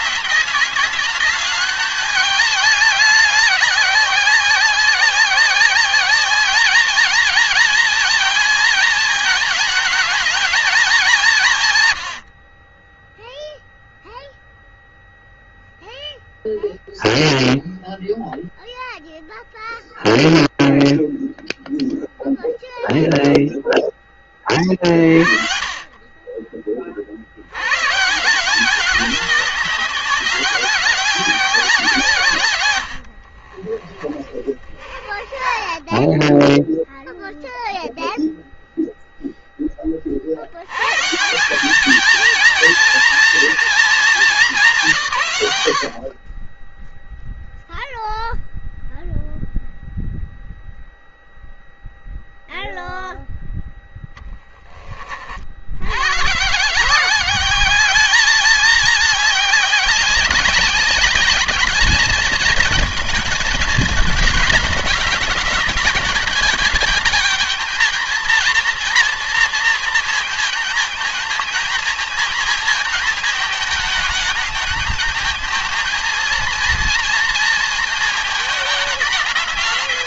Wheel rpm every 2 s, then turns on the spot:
200, 210, 190, 210, 220, 210, 40, 0, 0, 0, 0, 0, 20, 50, 190, 200, 130, 20, 10, 0, 70, 230, 210, 30, 0, 0, 0, 10, 140, 210, 190, 220, 220, 220, 240, 220, 220, 220, 230, 210.
32-38